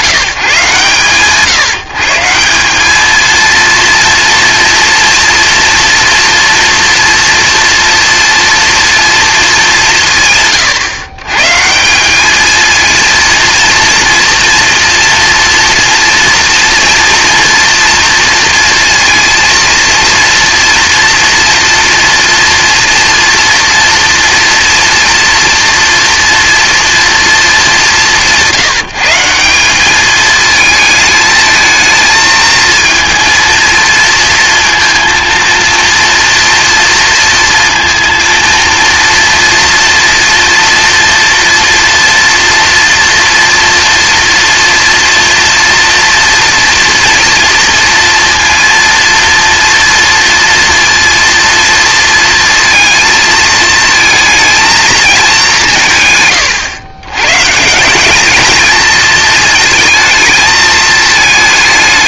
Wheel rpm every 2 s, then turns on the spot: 150, 190, 230, 230, 230, 120, 230, 240, 240, 230, 230, 230, 230, 230, 170, 220, 230, 230, 230, 230, 230, 230, 230, 230, 230, 230, 230, 230, 120, 220, 220.
none